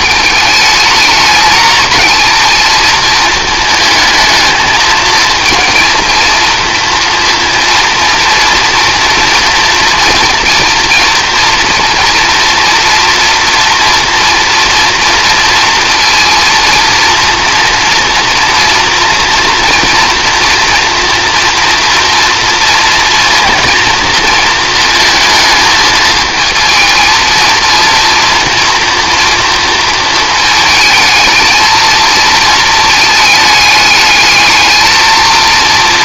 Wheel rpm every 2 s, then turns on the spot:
210, 220, 220, 230, 230, 230, 240, 240, 230, 230, 230, 230, 230, 220, 230, 220, 220, 220.
none